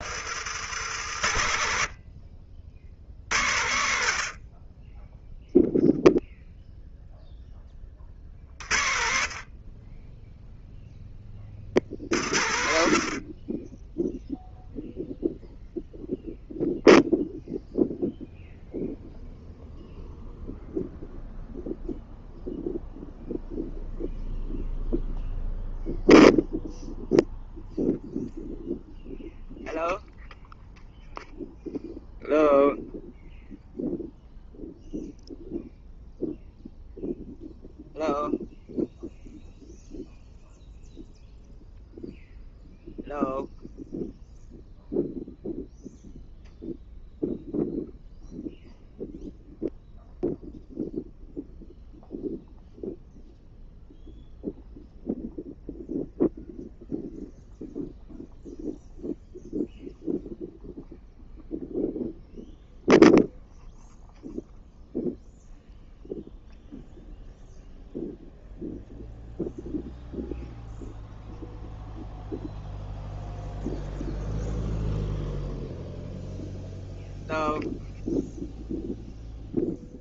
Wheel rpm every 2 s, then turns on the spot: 80, 80, 10, 0, 30, 20, 30, 0, 0, 0, 0, 0, 0, 0, 0, 0, 0, 0, 0, 0, 0, 0, 0, 0, 0, 0, 0, 0, 0, 0, 0, 0, 0, 0, 0, 0, 0, 0, 0, 0.
none